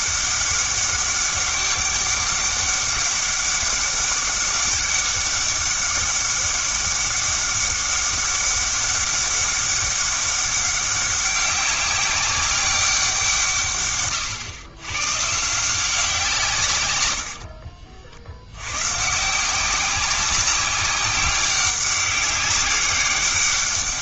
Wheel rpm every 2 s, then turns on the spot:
200, 200, 200, 200, 200, 200, 190, 120, 110, 130, 190, 200.
none